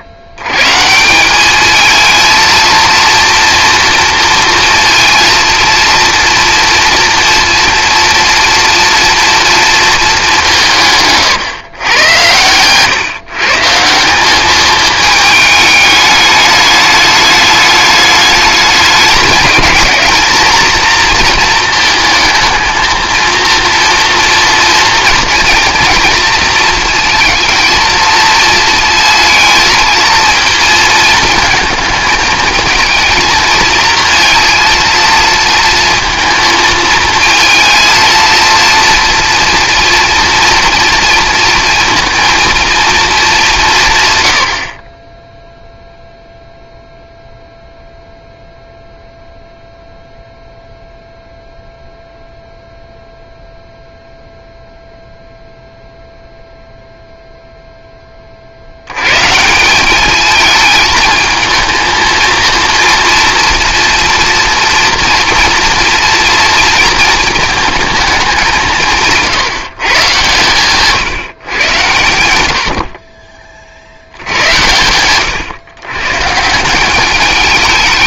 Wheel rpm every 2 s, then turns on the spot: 130, 230, 230, 230, 230, 160, 120, 210, 210, 210, 230, 220, 230, 230, 220, 220, 220, 230, 230, 230, 240, 230, 60, 0, 0, 0, 0, 0, 0, 90, 220, 230, 230, 240, 170, 140, 70, 110, 180.
none